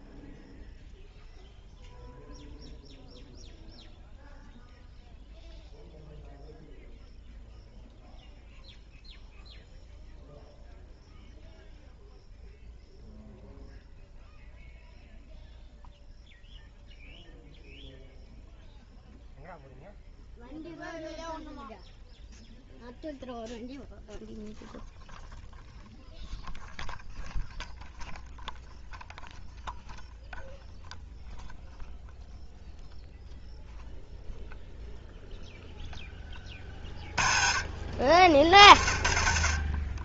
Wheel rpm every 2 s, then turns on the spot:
0, 0, 0, 0, 0, 0, 0, 0, 0, 0, 0, 0, 0, 0, 0, 0, 0, 0, 20, 40.
none